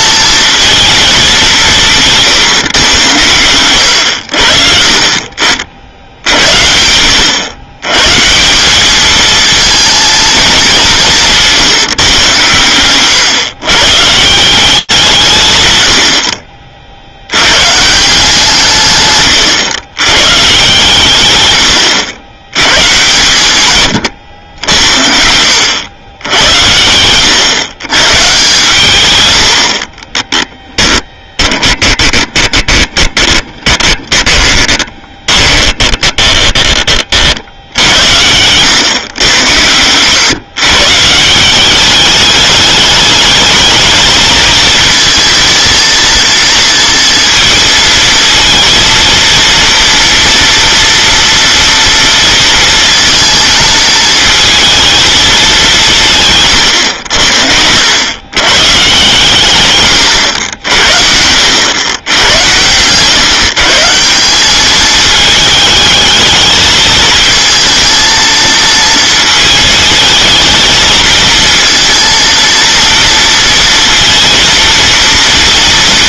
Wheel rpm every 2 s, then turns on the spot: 220, 120, 50, 80, 200, 210, 120, 180, 60, 140, 120, 120, 80, 100, 120, 10, 20, 20, 50, 110, 140, 210, 230, 230, 230, 230, 230, 220, 80, 140, 80, 120, 220, 220, 230, 220, 230, 230.
30-36